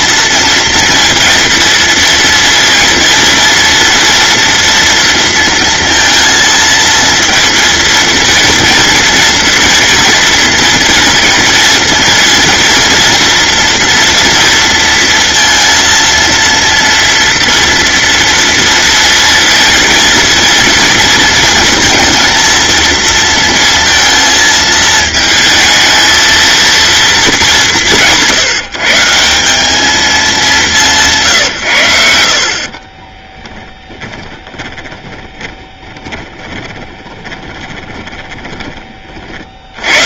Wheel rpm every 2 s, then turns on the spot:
230, 230, 230, 230, 230, 230, 230, 230, 230, 230, 230, 230, 220, 230, 160, 180, 30, 20, 20, 30.
32-38